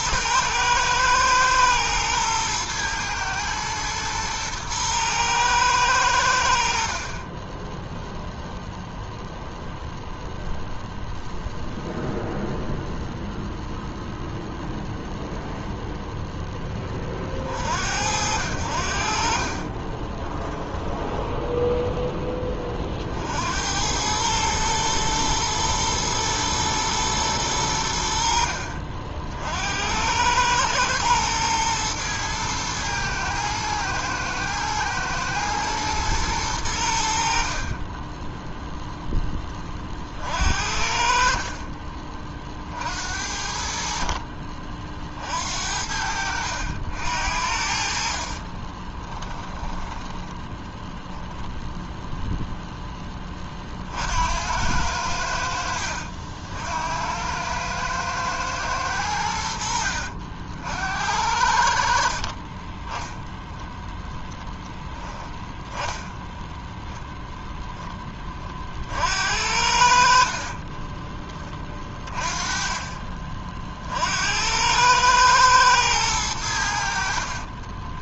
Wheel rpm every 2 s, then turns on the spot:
110, 110, 120, 70, 0, 0, 0, 0, 10, 70, 30, 30, 110, 110, 50, 110, 110, 110, 100, 0, 50, 50, 40, 70, 30, 10, 0, 80, 70, 110, 70, 20, 0, 0, 40, 40, 30, 90, 80.
20-22 48-50 70-72